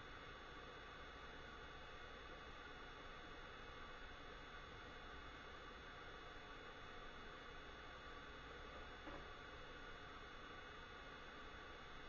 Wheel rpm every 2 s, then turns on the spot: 0, 0, 0, 0, 0, 0.
none